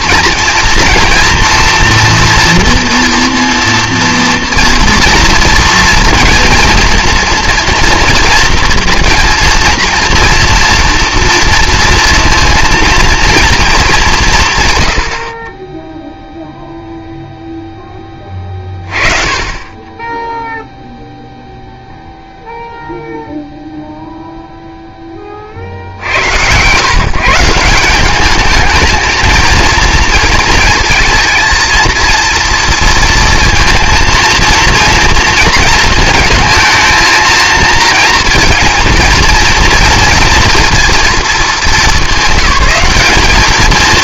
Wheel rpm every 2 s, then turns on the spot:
230, 230, 240, 230, 230, 230, 230, 130, 0, 20, 0, 0, 0, 110, 220, 230, 230, 230, 220, 230, 230, 200.
none